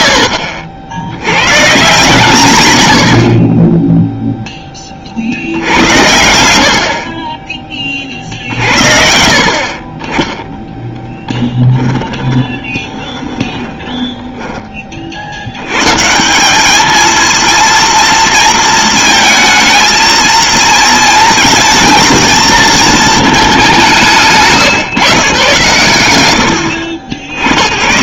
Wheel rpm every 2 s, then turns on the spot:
80, 70, 50, 30, 60, 10, 20, 60, 230, 220, 230, 220, 150, 80.
10-14